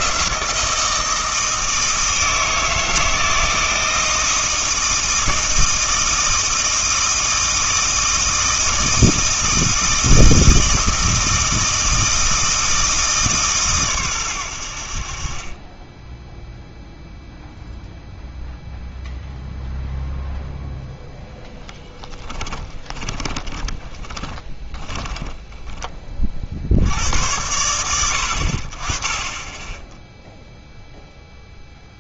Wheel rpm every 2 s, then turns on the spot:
160, 160, 160, 160, 160, 160, 160, 80, 0, 0, 0, 10, 20, 70, 40, 0.
22-26